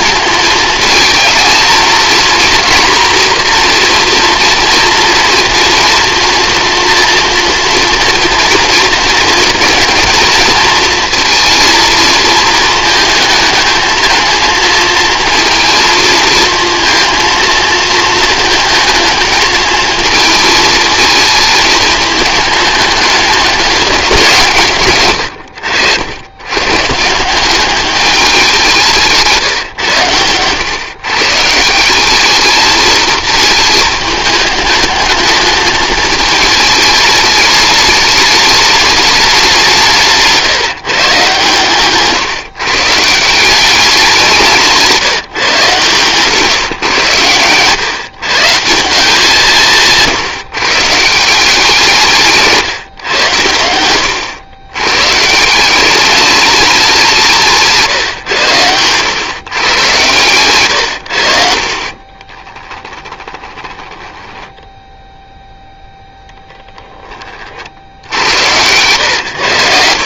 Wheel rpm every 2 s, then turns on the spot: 220, 240, 230, 230, 230, 230, 220, 230, 230, 220, 220, 210, 120, 140, 170, 120, 220, 220, 220, 210, 150, 150, 170, 130, 170, 160, 140, 120, 200, 120, 100, 20, 0, 10, 110.
62-64